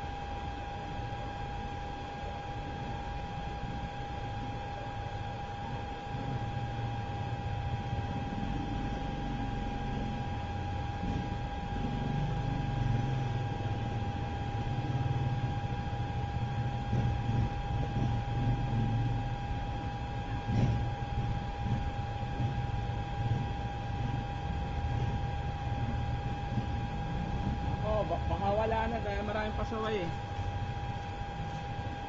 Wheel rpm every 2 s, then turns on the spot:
0, 0, 0, 0, 0, 0, 0, 0, 0, 0, 0, 0, 0, 0, 0, 0.
none